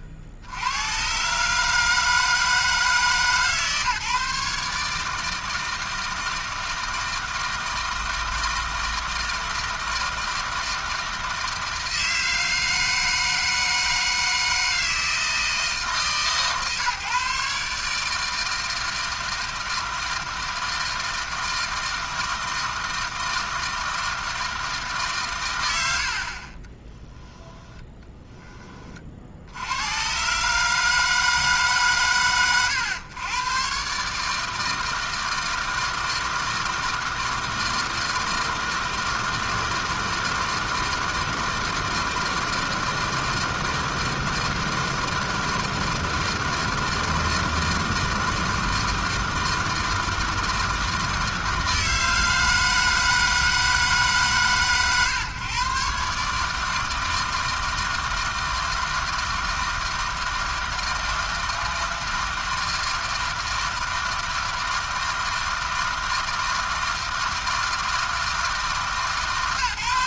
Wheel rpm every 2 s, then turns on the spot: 80, 160, 150, 160, 160, 160, 160, 160, 140, 160, 160, 160, 160, 50, 40, 150, 100, 160, 160, 160, 160, 160, 160, 160, 160, 160, 160, 110, 150, 160, 160, 160, 160, 160, 150.
26-28